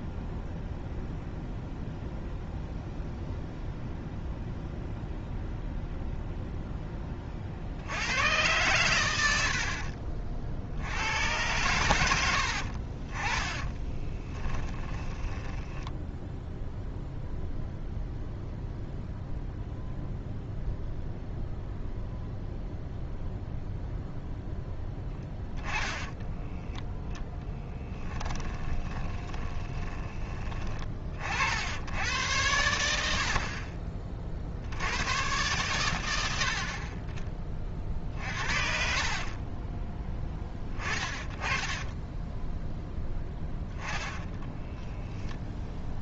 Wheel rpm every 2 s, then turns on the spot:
0, 0, 0, 10, 110, 80, 40, 10, 0, 0, 0, 0, 10, 0, 20, 40, 80, 90, 30, 50, 20, 10, 0.
14-16 24-26 28-30 38-42